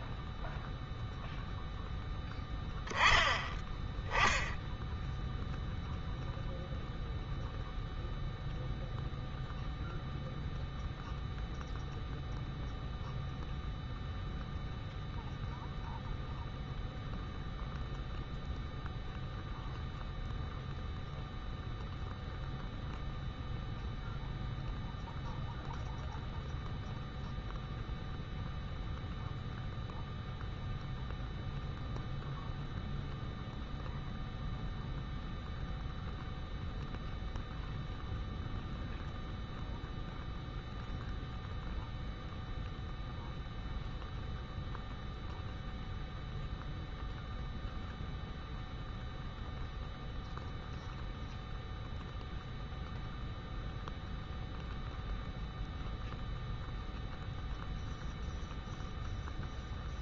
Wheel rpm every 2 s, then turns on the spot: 0, 10, 0, 0, 0, 0, 0, 0, 0, 0, 0, 0, 0, 0, 0, 0, 0, 0, 0, 0, 0, 0, 0, 0, 0, 0, 0, 0, 0, 0.
none